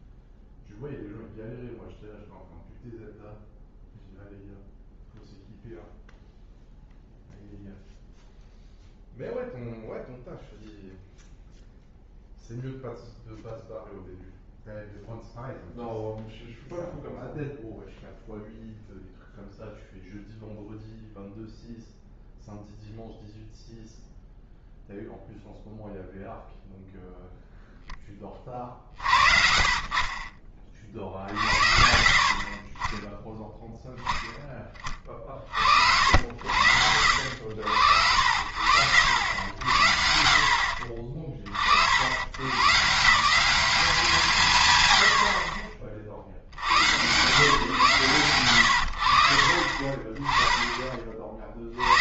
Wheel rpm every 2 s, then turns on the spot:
0, 0, 0, 0, 0, 0, 0, 0, 0, 0, 0, 0, 0, 0, 30, 30, 40, 10, 70, 70, 50, 130, 130, 70, 100, 20.
none